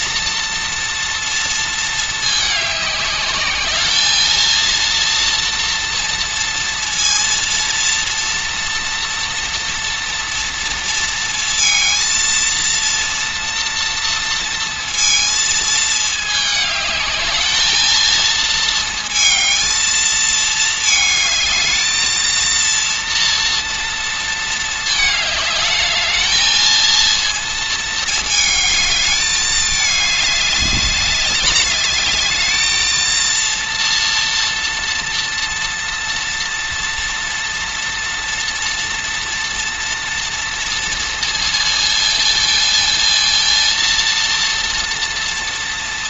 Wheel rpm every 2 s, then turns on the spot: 230, 200, 230, 230, 240, 230, 230, 230, 210, 230, 220, 230, 220, 230, 220, 200, 220, 230, 230, 230, 230, 230, 230.
none